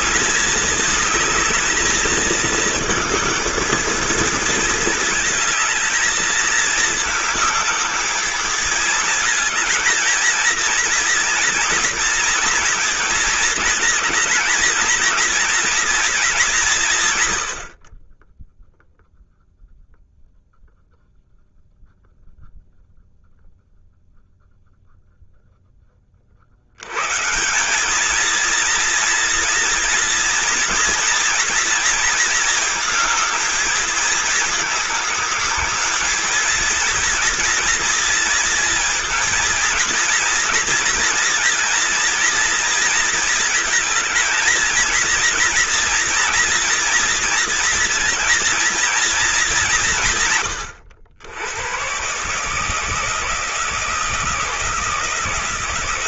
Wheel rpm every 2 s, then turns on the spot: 220, 220, 230, 220, 220, 230, 230, 230, 180, 10, 0, 0, 0, 70, 230, 230, 230, 210, 230, 230, 230, 230, 230, 230, 230, 90, 150, 160.
none